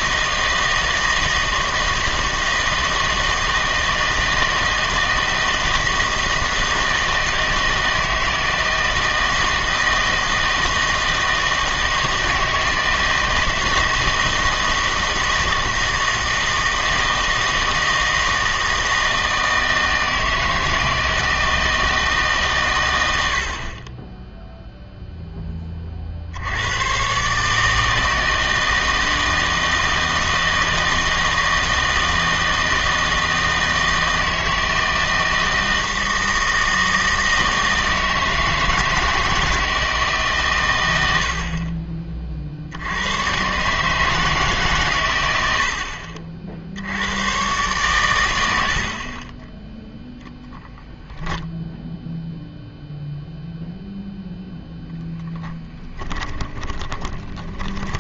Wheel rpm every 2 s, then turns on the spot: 160, 160, 160, 160, 160, 160, 160, 160, 160, 160, 160, 130, 0, 90, 160, 160, 160, 160, 160, 160, 120, 60, 130, 60, 70, 0, 0, 0, 20.
56-58